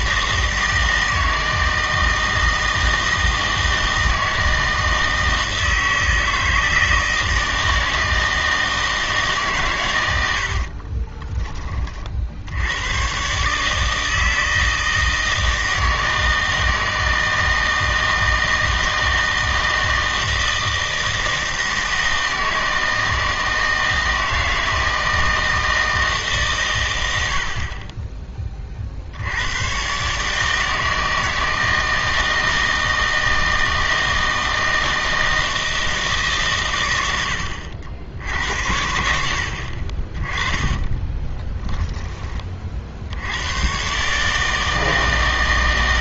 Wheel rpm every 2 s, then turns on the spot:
160, 160, 160, 160, 160, 40, 100, 160, 160, 160, 160, 160, 160, 110, 40, 160, 160, 160, 110, 80, 20, 50, 160.
10-12 40-42